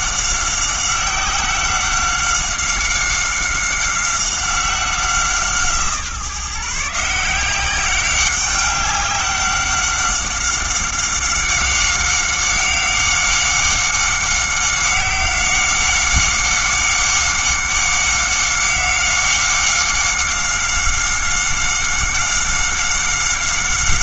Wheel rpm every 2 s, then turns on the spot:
190, 190, 180, 150, 200, 190, 190, 190, 190, 190, 190, 190.
none